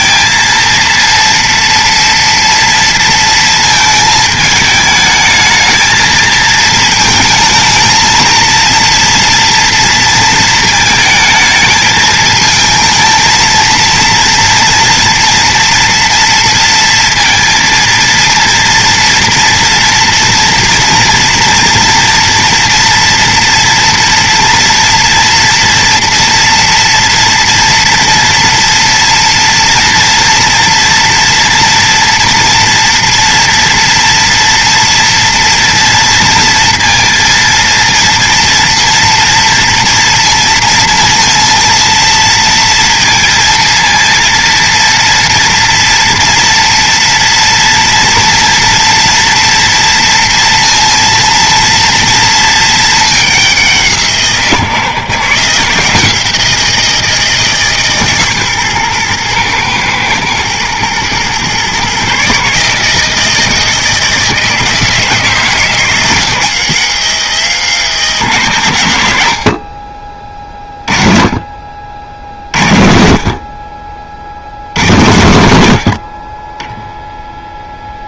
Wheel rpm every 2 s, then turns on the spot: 230, 230, 220, 220, 230, 220, 220, 230, 230, 230, 230, 230, 230, 230, 230, 230, 230, 230, 230, 240, 230, 230, 230, 230, 230, 230, 220, 150, 170, 130, 110, 150, 160, 160, 120, 30, 50, 80, 10.
none